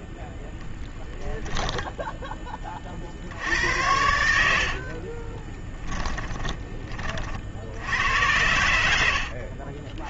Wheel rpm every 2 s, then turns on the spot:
0, 20, 60, 20, 80.
4-6